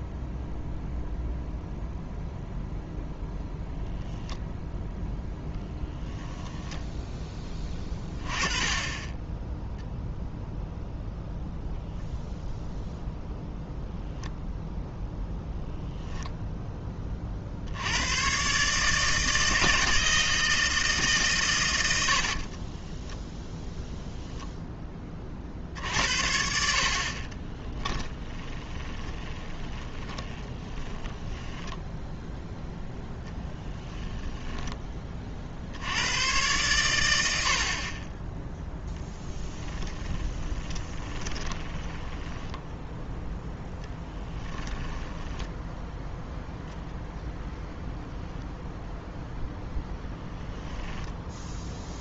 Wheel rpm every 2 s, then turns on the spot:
0, 0, 0, 0, 20, 0, 0, 0, 10, 140, 160, 30, 10, 50, 20, 10, 0, 10, 110, 0, 10, 0, 10, 0, 0, 10.
22-24 28-32 40-42 44-46